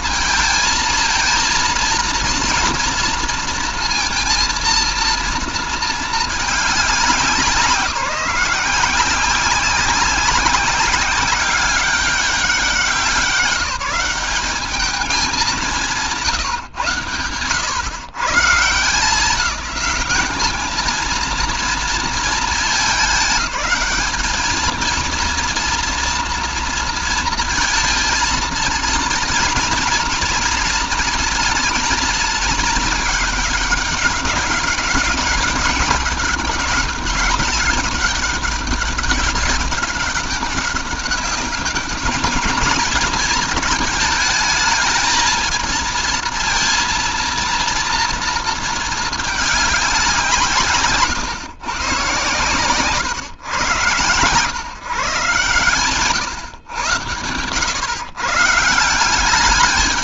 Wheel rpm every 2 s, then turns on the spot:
220, 230, 230, 200, 180, 190, 190, 200, 120, 160, 220, 220, 220, 230, 230, 230, 220, 200, 200, 200, 200, 220, 220, 230, 230, 140, 140, 130, 120, 160.
none